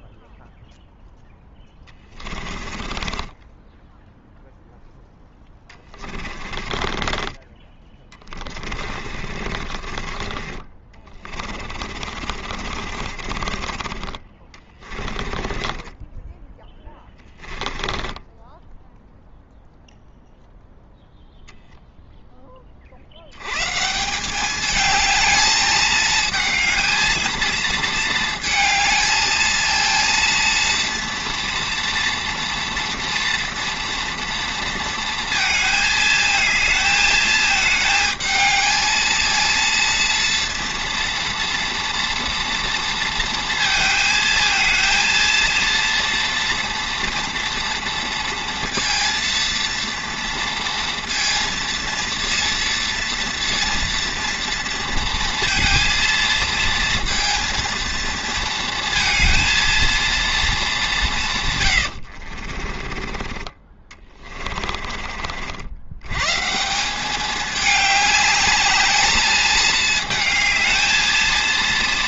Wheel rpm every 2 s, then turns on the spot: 0, 30, 0, 20, 30, 30, 40, 30, 10, 10, 0, 30, 200, 220, 220, 230, 240, 230, 220, 220, 230, 230, 230, 240, 230, 230, 230, 230, 230, 230, 210, 40, 30, 150, 210, 220.
2-4 6-10 12-20 62-66